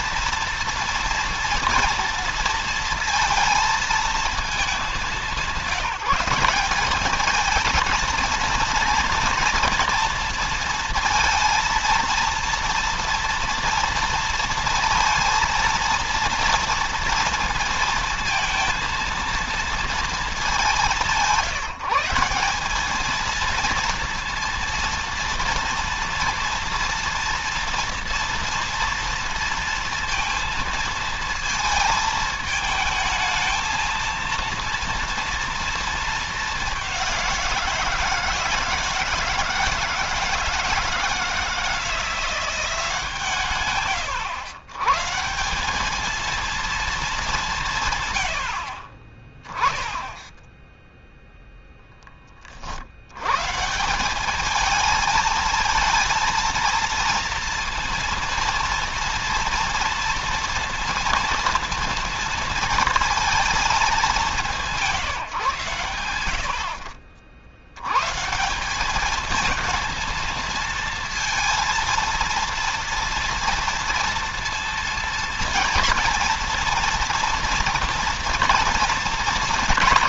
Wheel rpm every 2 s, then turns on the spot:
230, 230, 200, 210, 230, 230, 230, 230, 230, 230, 190, 210, 230, 230, 230, 230, 220, 230, 200, 160, 160, 160, 140, 220, 50, 0, 90, 220, 230, 230, 230, 230, 160, 60, 200, 220, 230, 230, 230, 230.
none